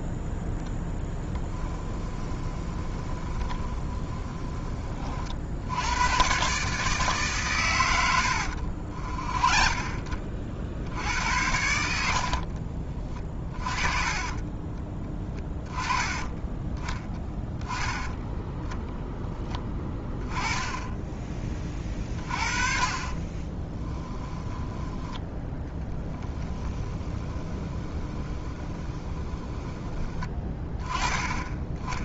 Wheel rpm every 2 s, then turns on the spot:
10, 20, 30, 140, 60, 70, 40, 20, 10, 0, 10, 30, 10, 10, 20, 20.
0-4 8-10 22-24 26-30